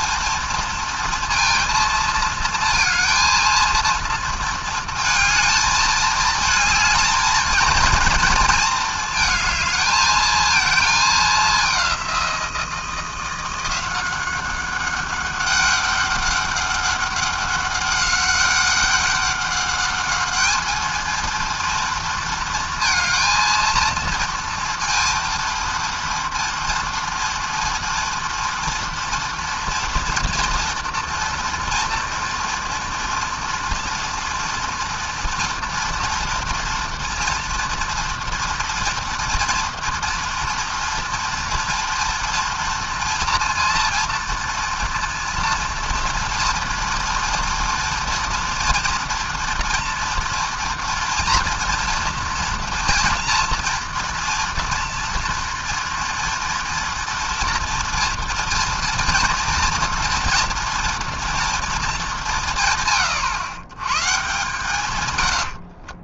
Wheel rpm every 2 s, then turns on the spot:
230, 230, 230, 220, 230, 220, 190, 180, 200, 200, 200, 230, 230, 230, 230, 230, 230, 240, 240, 230, 230, 230, 230, 230, 230, 230, 230, 230, 230, 230, 230, 210, 120.
none